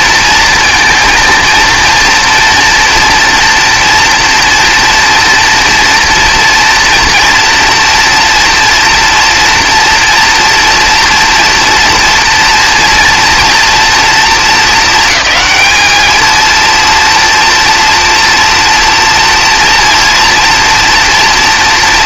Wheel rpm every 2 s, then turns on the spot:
230, 230, 230, 230, 230, 230, 240, 220, 230, 230, 230.
none